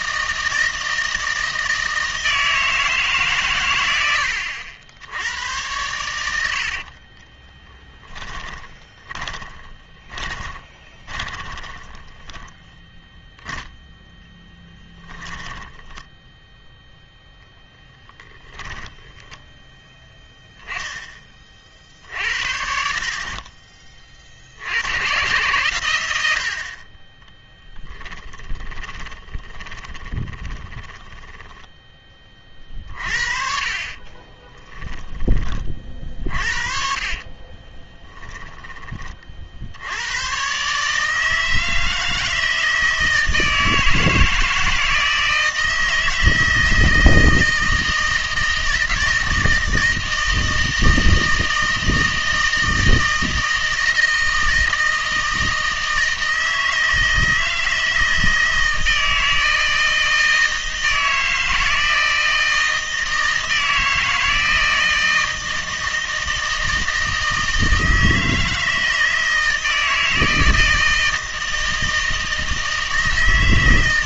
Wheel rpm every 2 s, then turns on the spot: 160, 160, 80, 50, 20, 30, 10, 10, 0, 10, 0, 60, 90, 40, 20, 20, 40, 10, 40, 20, 140, 160, 160, 160, 160, 160, 160, 160, 160, 160, 160, 160, 160, 160, 160, 160, 160.
6-12 14-16 18-20 28-32 36-38